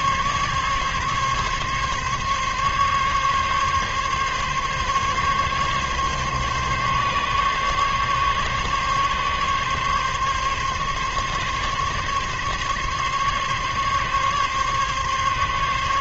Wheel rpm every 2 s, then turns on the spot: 140, 140, 140, 140, 140, 140, 140, 140.
none